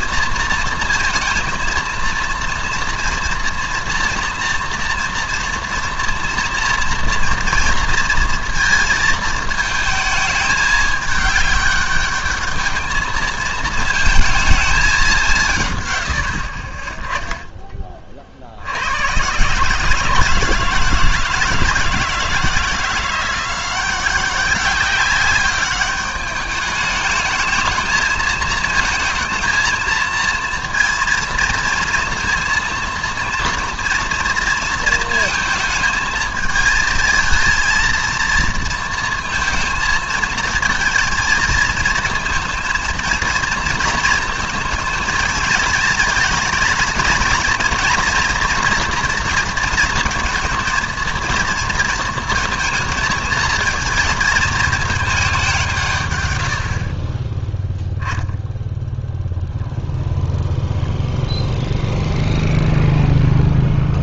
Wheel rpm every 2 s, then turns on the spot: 230, 230, 240, 230, 230, 210, 210, 220, 40, 70, 160, 170, 190, 210, 220, 230, 230, 230, 220, 230, 230, 220, 230, 230, 240, 230, 230, 220, 60, 0, 0, 0.
none